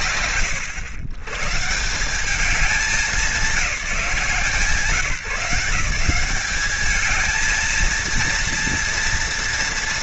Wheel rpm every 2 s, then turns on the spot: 130, 200, 180, 220, 230.
none